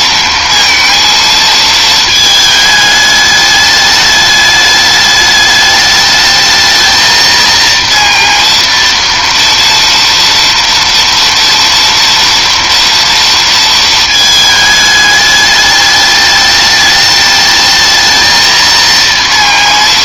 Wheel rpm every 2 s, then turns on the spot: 230, 220, 210, 210, 230, 230, 230, 220, 210, 220.
none